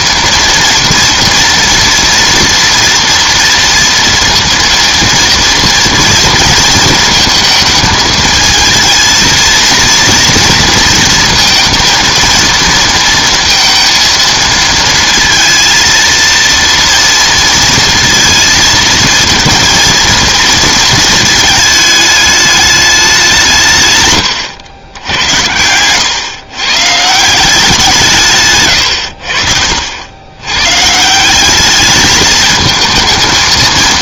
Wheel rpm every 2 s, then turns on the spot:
240, 240, 230, 220, 220, 230, 230, 230, 230, 230, 230, 210, 110, 120, 130, 130, 220.
24-26